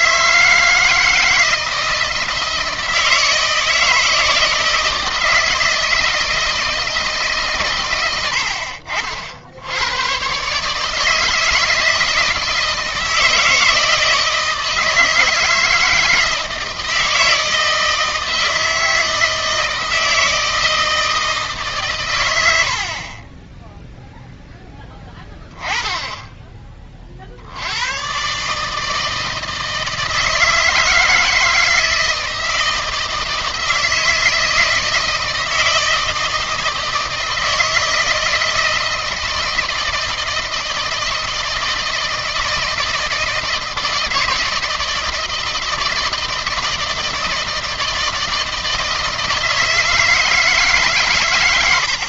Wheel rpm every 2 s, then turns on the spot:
160, 160, 160, 160, 60, 150, 160, 160, 160, 160, 160, 60, 10, 30, 150, 160, 160, 160, 160, 160, 160, 160, 160, 160, 160, 150.
none